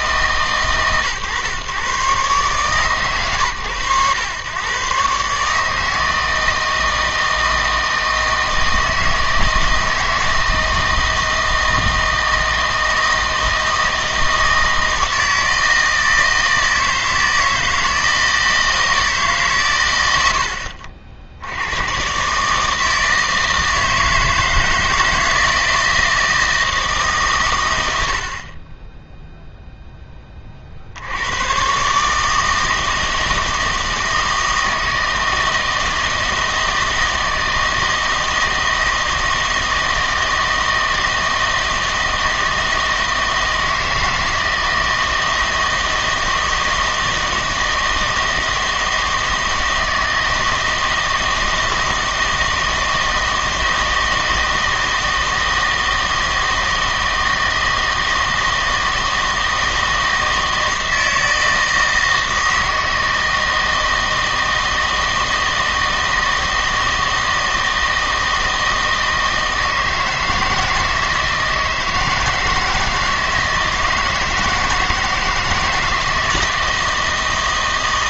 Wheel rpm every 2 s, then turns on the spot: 130, 130, 120, 160, 160, 160, 160, 160, 160, 160, 70, 150, 160, 160, 30, 40, 160, 160, 160, 160, 160, 160, 160, 160, 160, 160, 160, 160, 160, 160, 160, 160, 160, 160, 160, 160, 160, 160, 170.
none